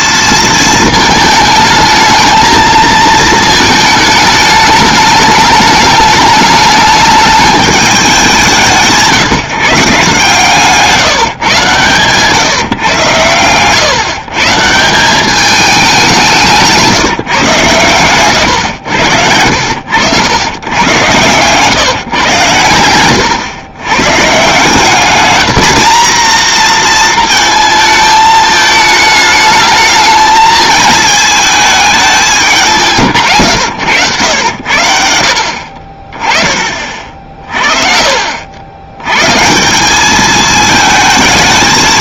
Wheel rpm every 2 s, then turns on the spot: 220, 220, 210, 210, 170, 150, 130, 170, 180, 100, 110, 110, 180, 230, 220, 220, 180, 80, 40, 90, 220.
16-20